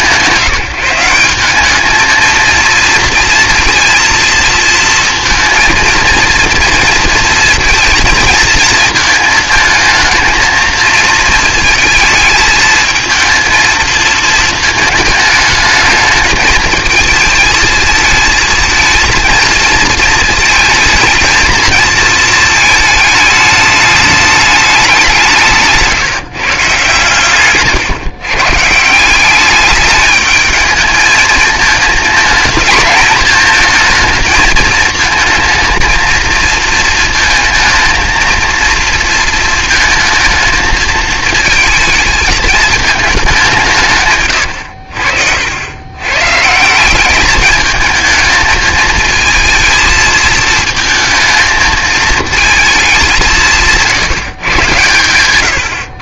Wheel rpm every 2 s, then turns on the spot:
180, 230, 230, 230, 230, 220, 220, 220, 220, 220, 220, 220, 200, 140, 150, 220, 220, 220, 220, 230, 220, 220, 90, 160, 220, 220, 220, 130.
none